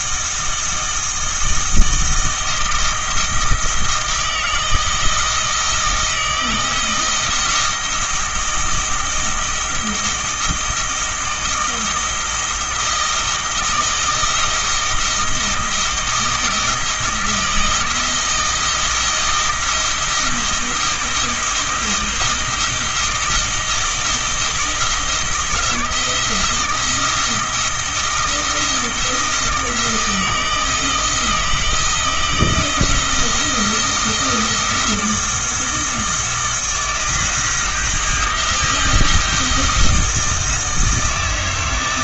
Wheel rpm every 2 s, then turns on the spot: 160, 160, 170, 170, 160, 160, 160, 160, 170, 160, 170, 160, 160, 170, 170, 160, 170, 160, 160, 160, 160.
none